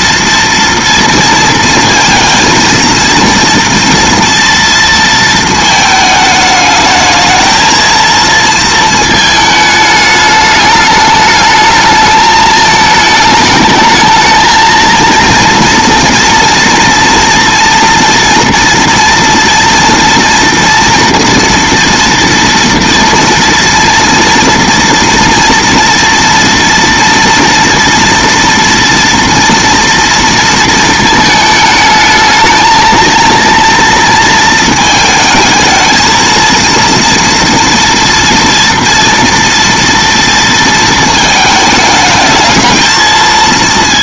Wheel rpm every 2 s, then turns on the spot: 230, 230, 230, 220, 220, 210, 220, 220, 230, 230, 240, 230, 240, 230, 230, 230, 220, 220, 230, 230, 230, 220.
none